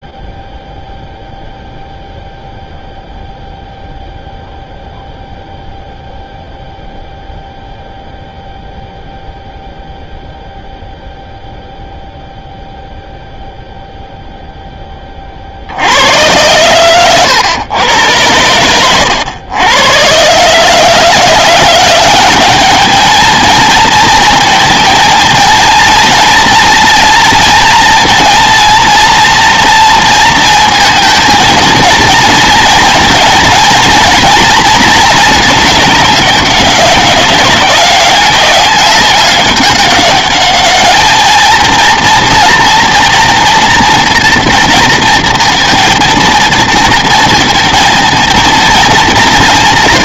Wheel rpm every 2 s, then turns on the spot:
0, 0, 0, 0, 0, 0, 0, 10, 110, 100, 150, 210, 220, 230, 240, 230, 230, 220, 200, 200, 210, 230, 230, 230, 220.
none